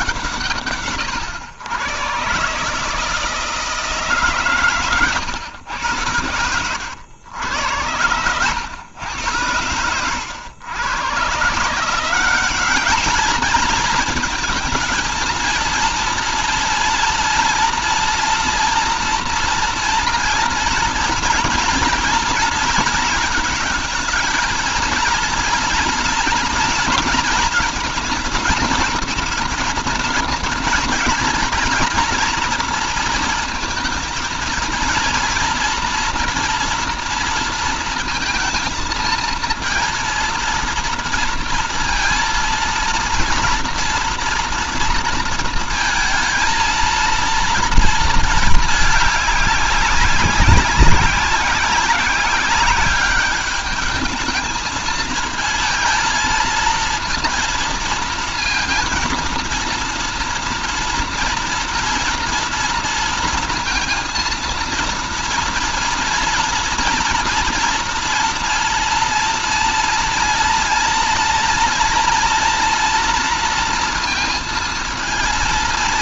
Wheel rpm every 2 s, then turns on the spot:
130, 150, 130, 100, 110, 100, 200, 220, 230, 240, 230, 220, 230, 230, 220, 220, 230, 230, 230, 230, 230, 230, 230, 230, 210, 190, 200, 220, 230, 230, 230, 230, 230, 230, 230, 230, 230, 230.
none